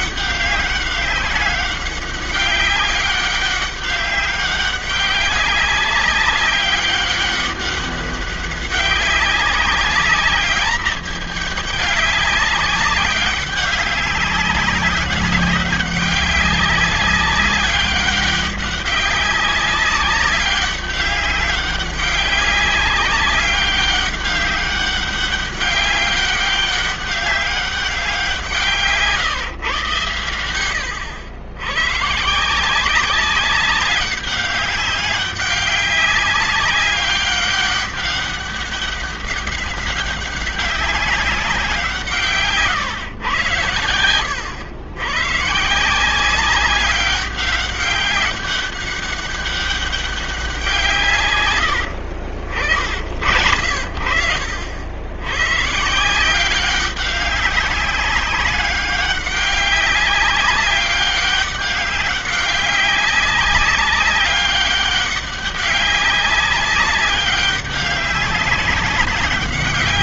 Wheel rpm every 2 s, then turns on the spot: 200, 200, 200, 190, 200, 210, 200, 190, 200, 200, 200, 190, 200, 200, 160, 90, 160, 200, 190, 200, 190, 150, 100, 180, 200, 180, 60, 70, 190, 200, 200, 200, 200, 200, 190.
none